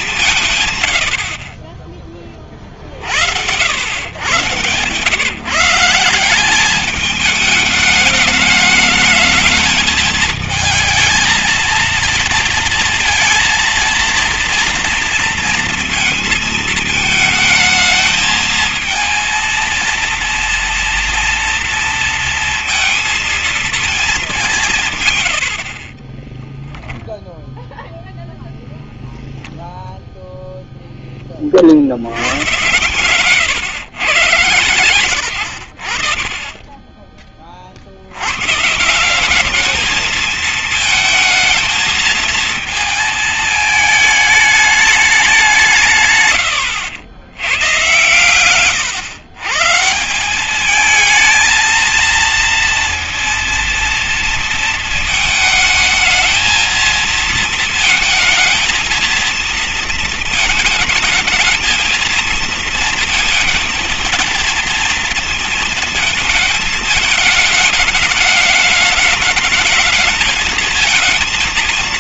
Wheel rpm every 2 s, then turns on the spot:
150, 30, 120, 190, 210, 220, 230, 230, 230, 220, 230, 230, 200, 20, 0, 0, 110, 120, 30, 130, 220, 220, 210, 110, 110, 190, 230, 230, 220, 220, 220, 230, 230, 210, 210, 220.
26-28